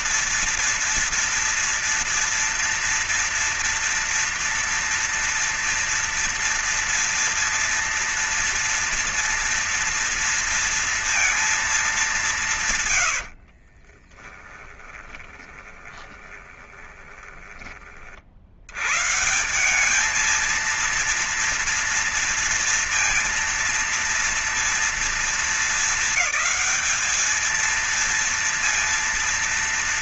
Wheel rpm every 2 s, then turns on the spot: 240, 230, 230, 230, 230, 230, 150, 20, 20, 90, 220, 230, 230, 200, 230.
14-18